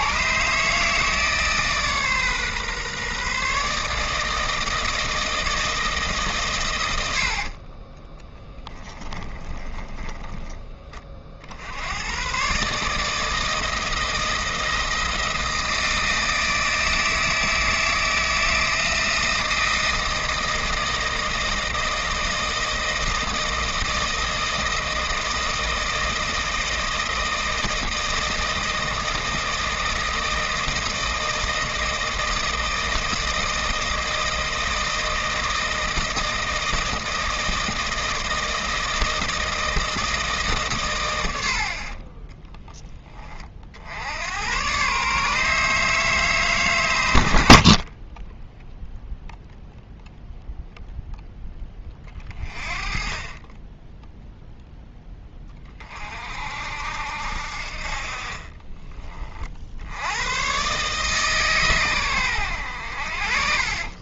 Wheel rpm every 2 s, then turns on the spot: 150, 140, 160, 120, 10, 20, 140, 160, 160, 160, 160, 160, 160, 160, 160, 160, 160, 160, 160, 160, 130, 10, 120, 140, 10, 0, 30, 0, 60, 20, 120, 90.
8-10 58-60